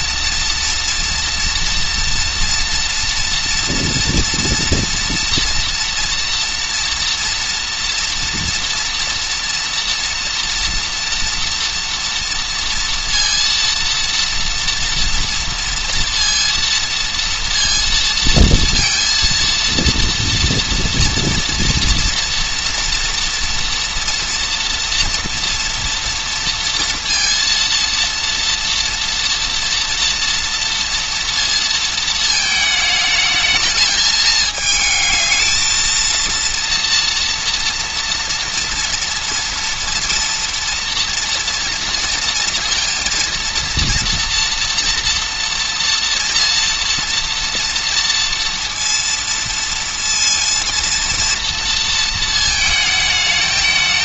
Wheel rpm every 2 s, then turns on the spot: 230, 230, 230, 230, 230, 230, 230, 230, 230, 230, 230, 240, 240, 230, 230, 230, 220, 220, 230, 230, 230, 230, 230, 230, 230, 230, 220.
none